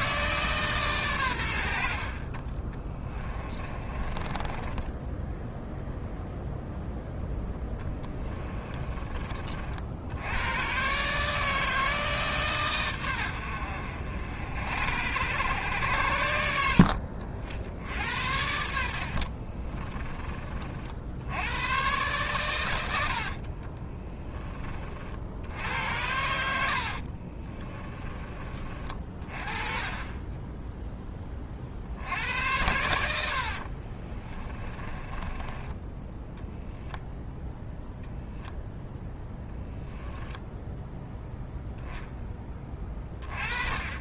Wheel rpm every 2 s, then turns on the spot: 130, 20, 10, 0, 20, 130, 110, 80, 70, 70, 60, 90, 30, 70, 30, 10, 80, 20, 0, 10, 0, 20.
2-6 8-10 18-20 22-24 26-28 34-36